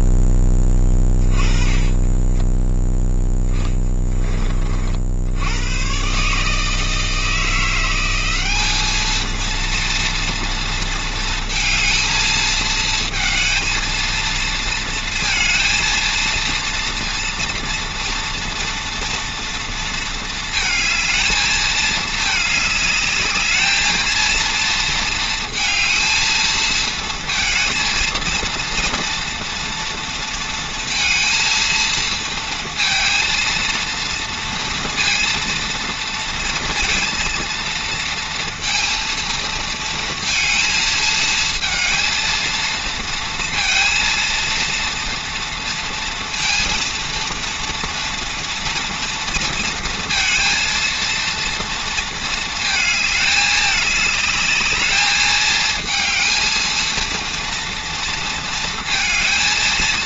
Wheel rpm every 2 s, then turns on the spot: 20, 0, 60, 160, 220, 220, 220, 230, 230, 240, 220, 210, 230, 230, 230, 230, 230, 230, 230, 230, 220, 230, 230, 230, 230, 230, 220, 210, 230, 230.
0-2